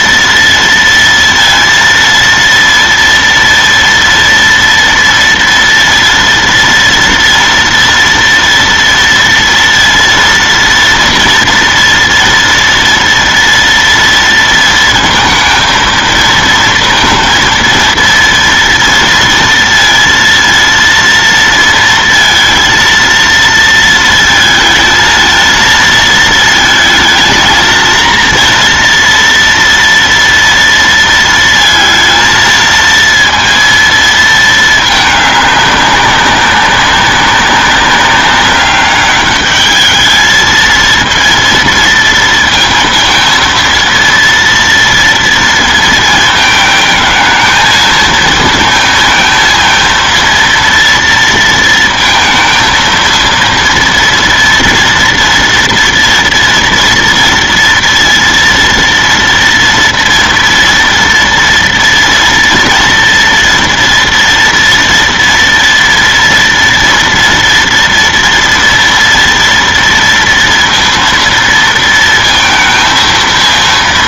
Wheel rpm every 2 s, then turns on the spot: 230, 230, 230, 230, 230, 230, 230, 230, 230, 230, 230, 230, 220, 220, 230, 230, 230, 210, 200, 200, 230, 230, 230, 220, 230, 230, 230, 230, 230, 230, 230, 230, 230, 230, 230, 230, 230.
none